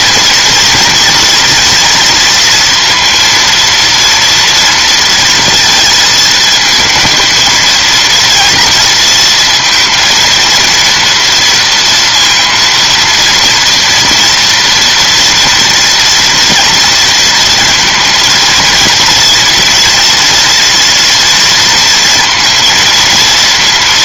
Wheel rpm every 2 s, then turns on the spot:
230, 230, 230, 220, 230, 230, 230, 240, 230, 230, 230, 230.
none